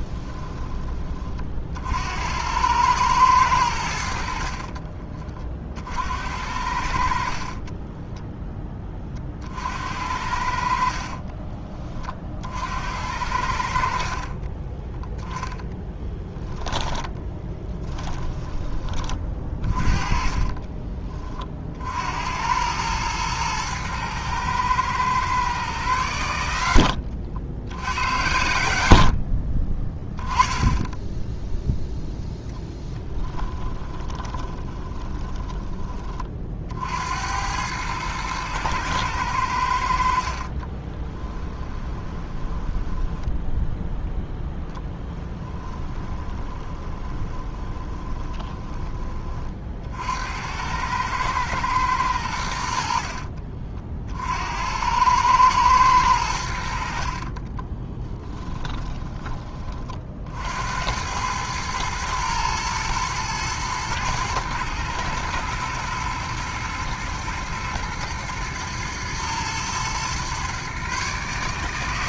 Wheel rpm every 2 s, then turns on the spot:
20, 100, 50, 60, 10, 50, 60, 20, 10, 20, 20, 100, 110, 80, 80, 10, 10, 20, 60, 110, 30, 10, 0, 20, 20, 100, 80, 80, 70, 10, 80, 110, 110, 110, 120, 130.
4-6 14-18 20-22 26-28 34-36 40-44 46-50 58-60